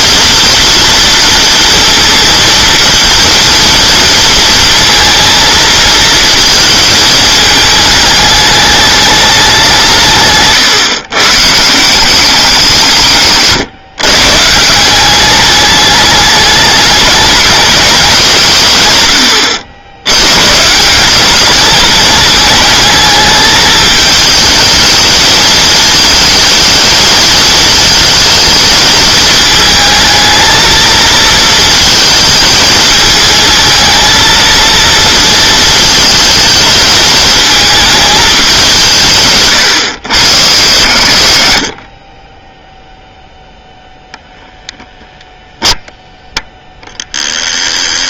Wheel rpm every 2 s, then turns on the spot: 230, 230, 230, 230, 210, 130, 170, 160, 210, 120, 150, 220, 220, 220, 220, 230, 220, 230, 220, 170, 60, 0, 0, 0.
none